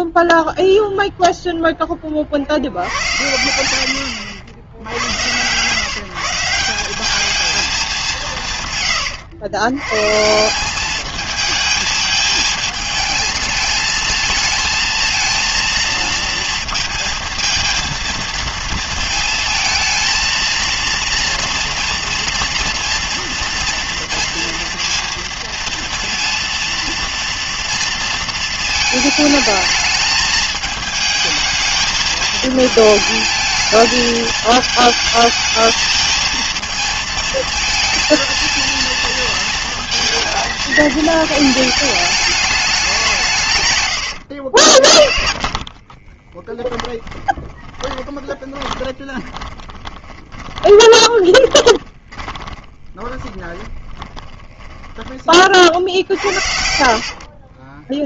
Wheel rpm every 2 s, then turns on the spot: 0, 70, 80, 170, 150, 190, 220, 220, 230, 230, 230, 230, 230, 230, 230, 220, 220, 220, 230, 220, 230, 200, 70, 10, 20, 20, 20, 30, 60.
44-56